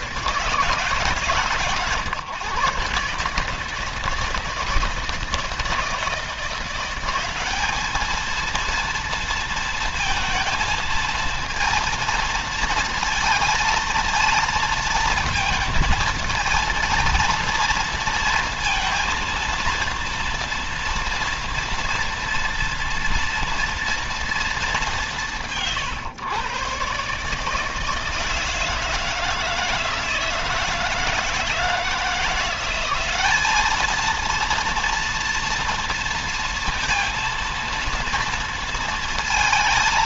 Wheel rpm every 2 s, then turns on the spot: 150, 140, 160, 180, 230, 220, 230, 230, 230, 230, 230, 230, 200, 130, 160, 160, 190, 230, 230, 230.
none